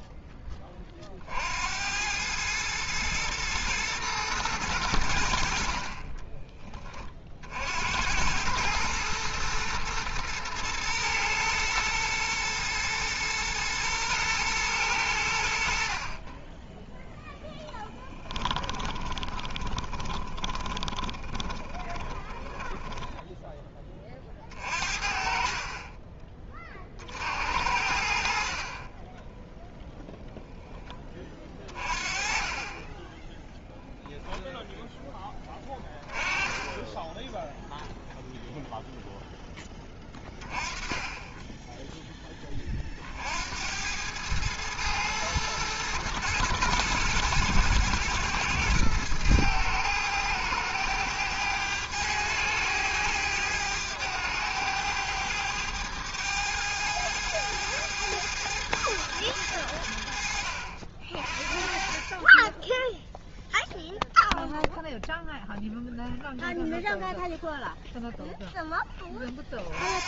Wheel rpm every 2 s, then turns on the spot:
20, 110, 100, 20, 110, 120, 120, 110, 10, 10, 20, 10, 40, 40, 30, 10, 20, 0, 10, 0, 20, 30, 110, 110, 110, 110, 110, 100, 110, 110, 50, 10, 0, 0, 10.
18-24 32-34